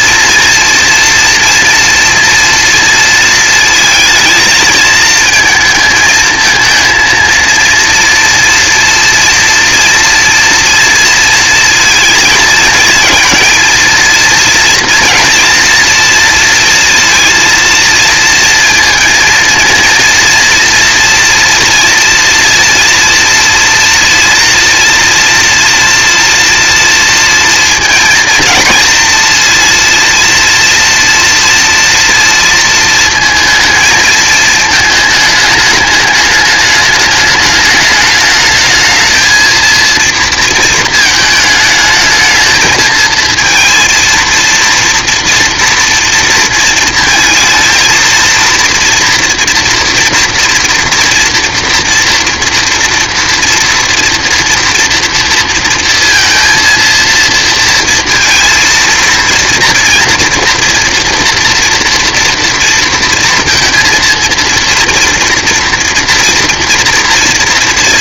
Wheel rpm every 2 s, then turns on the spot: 230, 230, 220, 220, 230, 230, 230, 230, 230, 230, 230, 240, 230, 240, 230, 230, 230, 220, 210, 220, 230, 220, 230, 230, 240, 230, 230, 230, 230, 230, 230, 230, 230, 230.
none